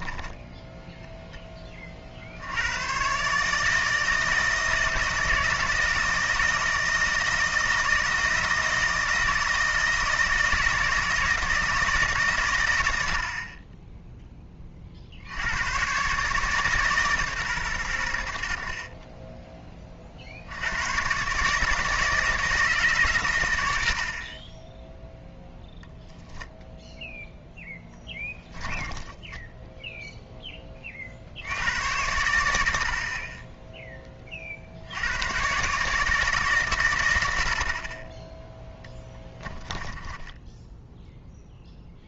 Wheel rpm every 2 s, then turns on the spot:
0, 100, 160, 160, 160, 160, 130, 20, 150, 50, 90, 150, 20, 0, 20, 20, 80, 60, 130, 10, 10.
28-30 38-42